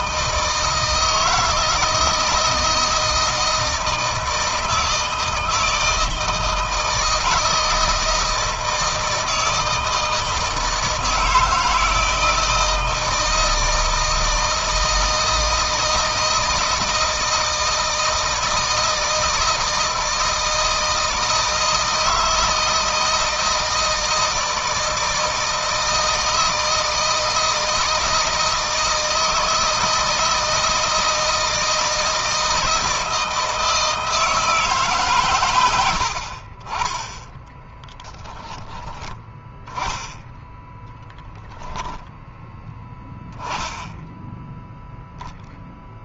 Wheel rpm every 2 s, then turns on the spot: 160, 160, 160, 160, 160, 160, 160, 160, 160, 160, 160, 160, 160, 160, 160, 160, 160, 150, 30, 10, 10, 10, 0.
none